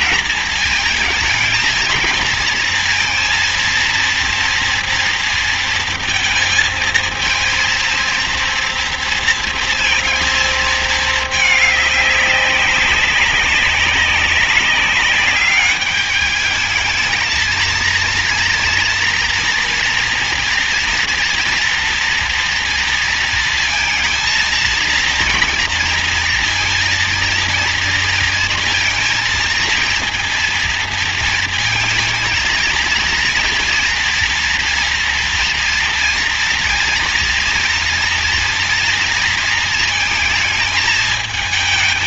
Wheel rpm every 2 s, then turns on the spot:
220, 220, 230, 230, 230, 220, 190, 200, 220, 230, 230, 230, 230, 230, 230, 230, 230, 240, 230, 230, 220.
none